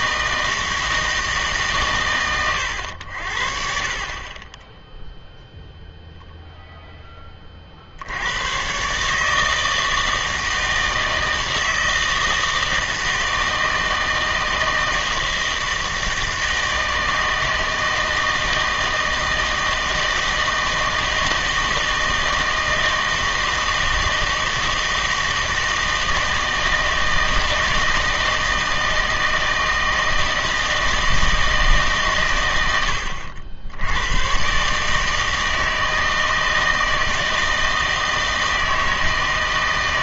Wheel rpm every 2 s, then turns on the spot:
160, 100, 10, 0, 130, 160, 160, 160, 160, 160, 160, 160, 160, 160, 160, 160, 80, 150, 160, 160.
4-6